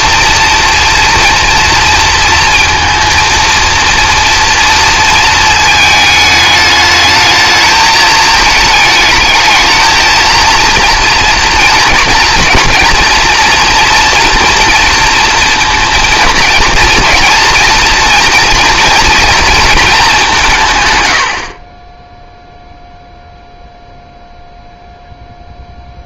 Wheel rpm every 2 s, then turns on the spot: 230, 230, 230, 210, 220, 230, 230, 230, 220, 230, 150, 0, 0.
none